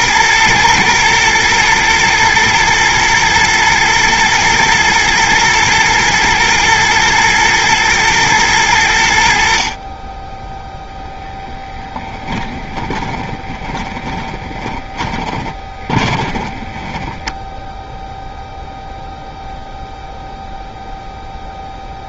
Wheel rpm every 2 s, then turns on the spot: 120, 120, 120, 110, 80, 0, 20, 20, 10, 0, 0.
12-18